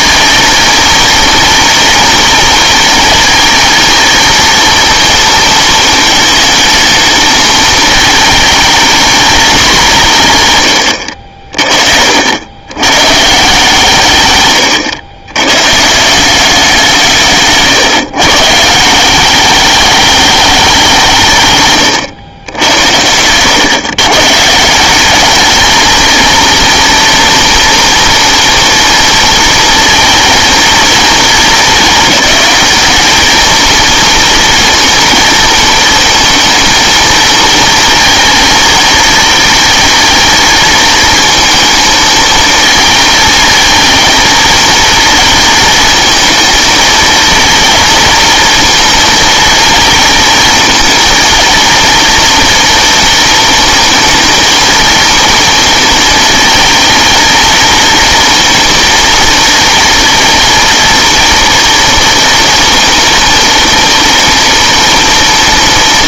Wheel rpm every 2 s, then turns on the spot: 230, 230, 230, 220, 220, 120, 100, 120, 180, 160, 200, 90, 170, 230, 230, 220, 200, 230, 220, 230, 230, 220, 220, 220, 230, 230, 230, 230, 220, 230, 230, 230, 240.
none